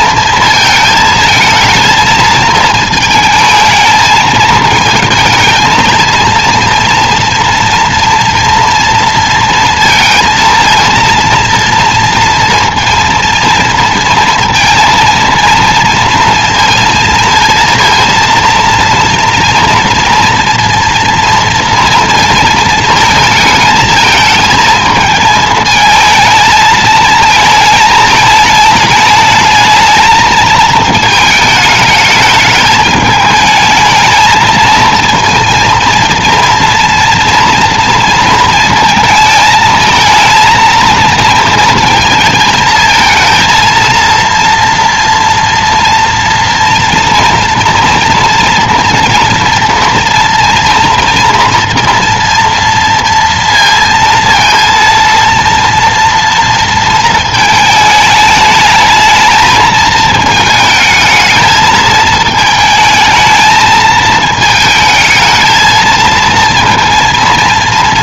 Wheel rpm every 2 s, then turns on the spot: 230, 220, 220, 230, 230, 230, 230, 230, 230, 230, 230, 230, 220, 220, 210, 220, 210, 230, 230, 230, 230, 220, 230, 230, 230, 230, 230, 230, 230, 220, 220, 220, 220, 230.
none